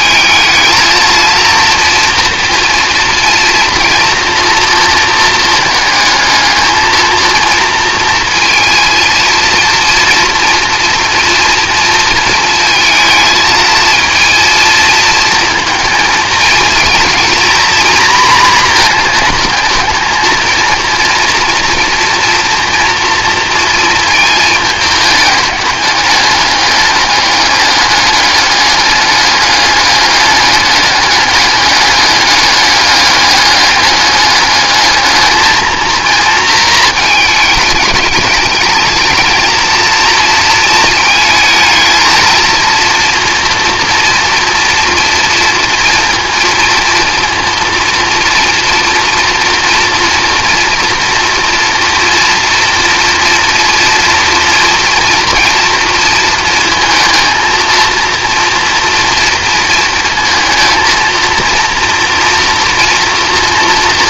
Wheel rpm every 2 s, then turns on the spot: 230, 230, 230, 220, 230, 230, 220, 230, 230, 230, 230, 230, 210, 200, 200, 200, 200, 210, 230, 210, 230, 230, 230, 230, 230, 230, 230, 230, 230, 230, 230, 230.
none